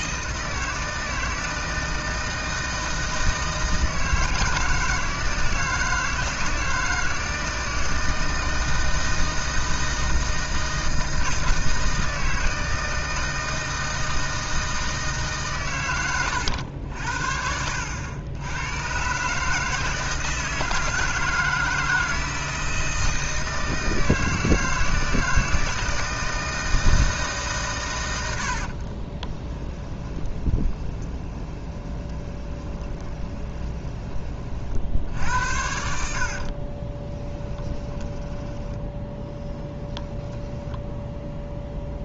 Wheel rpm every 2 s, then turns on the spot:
160, 160, 160, 160, 160, 160, 160, 160, 90, 110, 160, 160, 160, 160, 60, 20, 20, 50, 50, 10, 10.
28-34 36-40